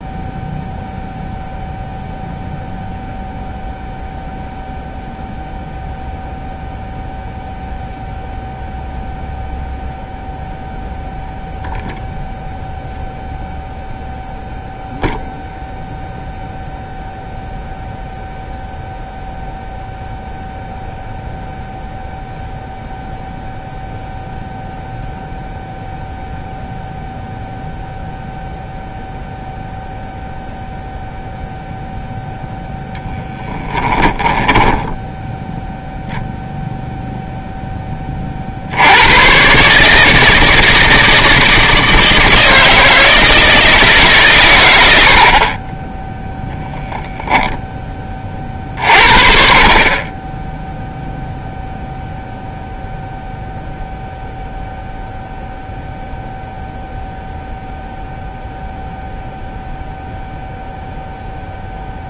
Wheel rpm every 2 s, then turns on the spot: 0, 0, 0, 0, 0, 0, 0, 0, 0, 0, 0, 0, 0, 0, 0, 0, 0, 10, 0, 80, 160, 160, 90, 0, 50, 0, 0, 0, 0, 0, 0.
34-36